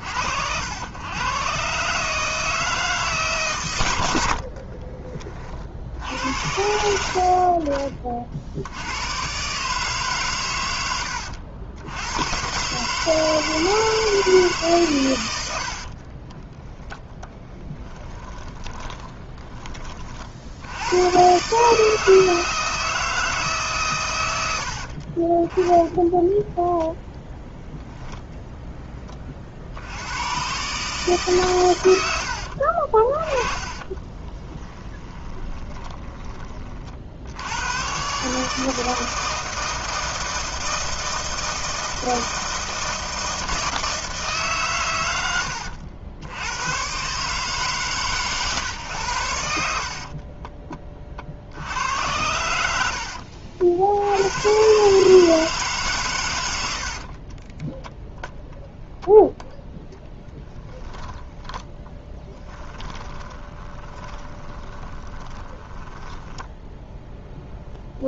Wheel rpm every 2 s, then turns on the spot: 80, 160, 50, 70, 70, 110, 140, 140, 10, 20, 70, 160, 80, 10, 0, 120, 50, 20, 30, 150, 160, 160, 140, 100, 130, 30, 90, 120, 100, 0, 10, 10, 20, 10.
4-6 18-20 32-36 56-58 62-68